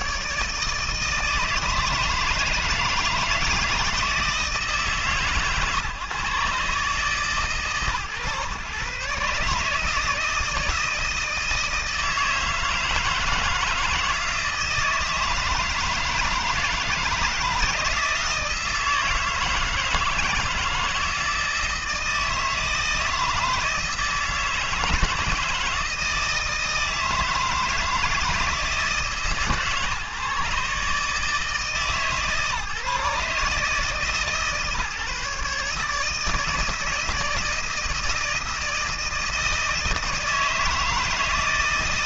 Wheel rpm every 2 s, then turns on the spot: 160, 160, 150, 140, 130, 160, 160, 160, 160, 160, 170, 160, 160, 160, 150, 150, 140, 150, 150, 160, 160.
none